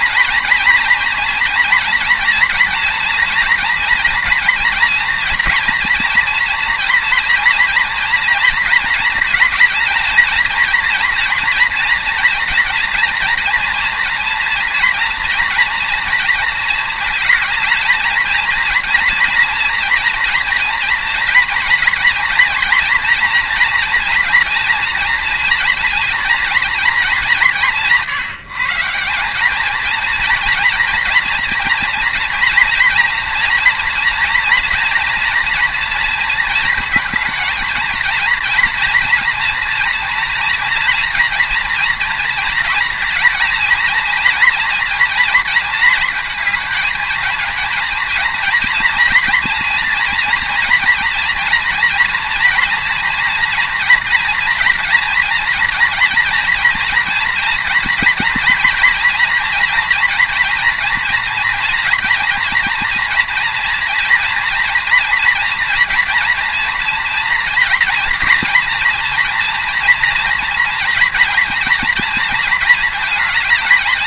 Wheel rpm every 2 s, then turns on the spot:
230, 230, 230, 230, 230, 230, 230, 230, 220, 230, 240, 230, 230, 210, 170, 230, 240, 230, 230, 230, 240, 230, 240, 220, 230, 230, 230, 230, 230, 230, 230, 230, 230, 230, 240, 240, 230.
none